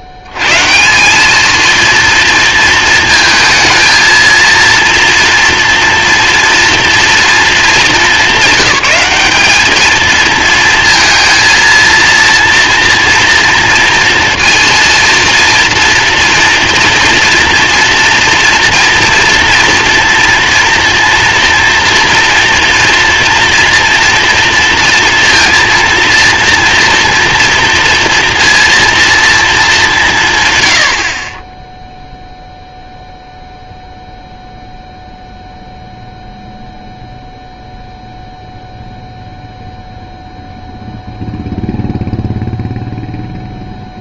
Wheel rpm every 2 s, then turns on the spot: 80, 230, 230, 230, 210, 220, 230, 230, 230, 240, 230, 240, 230, 230, 230, 120, 0, 0, 0, 0, 0, 0.
none